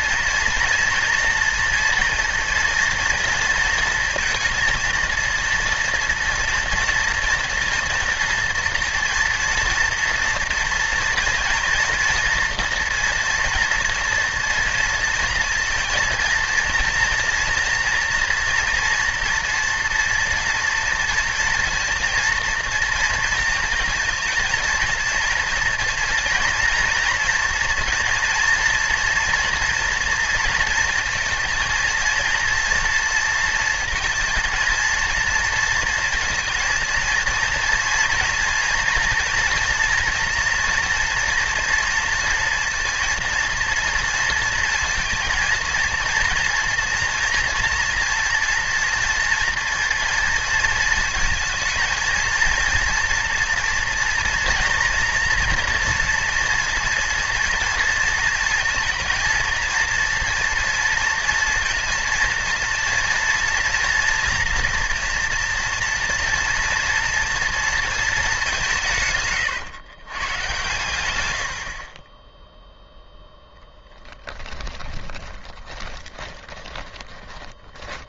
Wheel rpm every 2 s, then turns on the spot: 230, 230, 230, 230, 230, 230, 230, 230, 230, 230, 230, 230, 230, 230, 230, 230, 230, 230, 230, 240, 230, 230, 230, 240, 230, 220, 230, 230, 230, 230, 230, 230, 230, 240, 160, 120, 0, 20, 20.
74-78